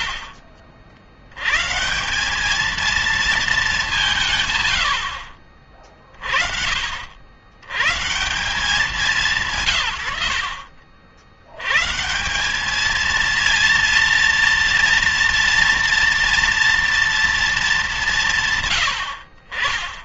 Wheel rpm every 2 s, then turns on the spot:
60, 220, 100, 60, 180, 50, 210, 230, 230, 110.
none